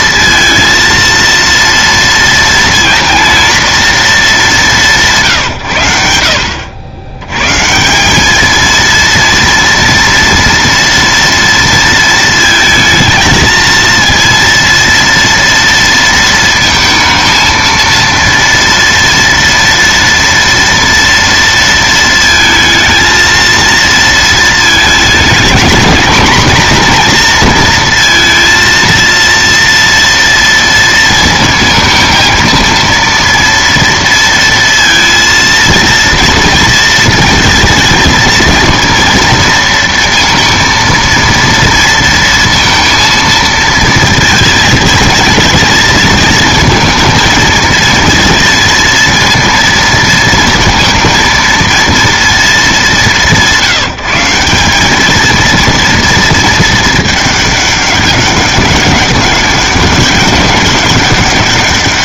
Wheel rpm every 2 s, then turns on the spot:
230, 230, 200, 80, 220, 230, 220, 230, 230, 230, 230, 220, 220, 220, 230, 230, 230, 230, 230, 220, 230, 230, 220, 220, 230, 230, 220, 190, 230, 200, 200.
none